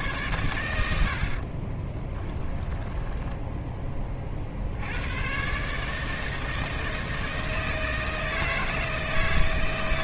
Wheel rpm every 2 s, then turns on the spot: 90, 10, 90, 160, 160.
2-4